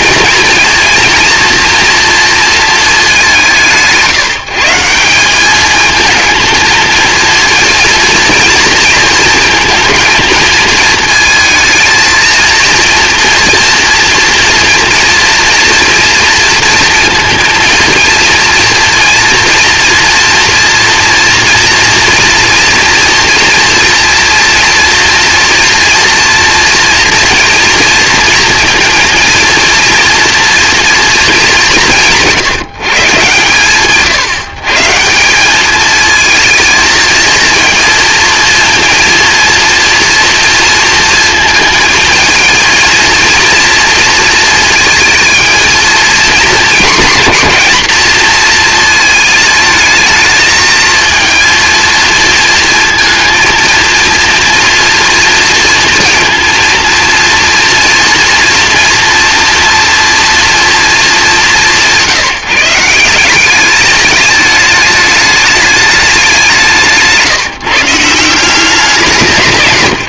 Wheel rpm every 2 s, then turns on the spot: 230, 230, 160, 220, 230, 220, 230, 230, 230, 230, 230, 230, 230, 240, 230, 230, 160, 140, 220, 230, 230, 230, 220, 230, 230, 220, 220, 230, 230, 230, 240, 170, 210, 180, 180.
none